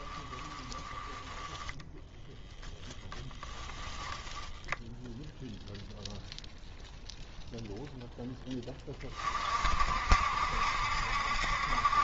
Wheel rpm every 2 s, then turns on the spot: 10, 0, 0, 0, 20, 70.
none